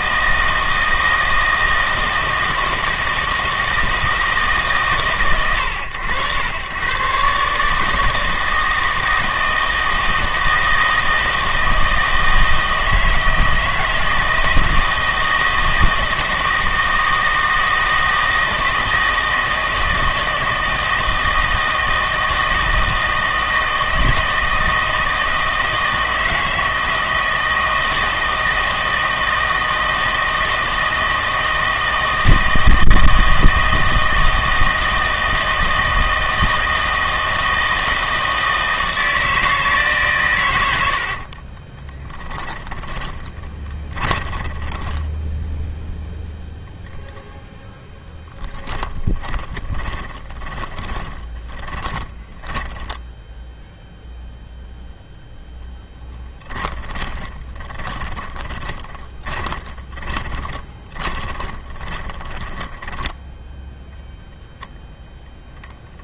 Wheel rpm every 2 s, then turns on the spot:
160, 160, 130, 120, 160, 160, 160, 160, 160, 160, 160, 160, 160, 160, 160, 160, 160, 160, 160, 160, 80, 10, 10, 0, 20, 20, 20, 0, 20, 20, 20, 10, 0.
40-46 48-54 56-64